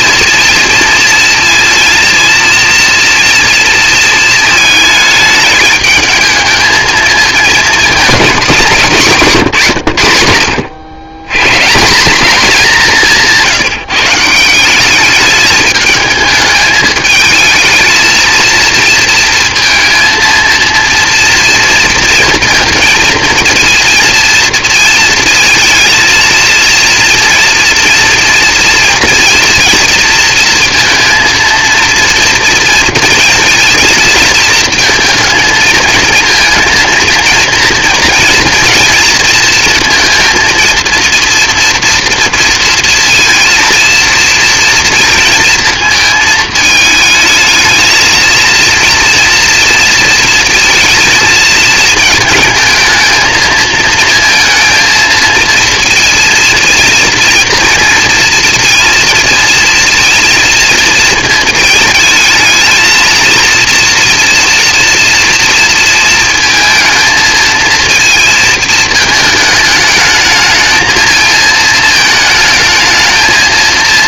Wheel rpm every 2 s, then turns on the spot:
230, 230, 220, 230, 150, 110, 180, 210, 220, 230, 230, 230, 230, 230, 230, 230, 230, 230, 230, 230, 230, 230, 230, 220, 230, 230, 220, 230, 240, 230, 230, 230, 230, 220, 220, 220, 220.
none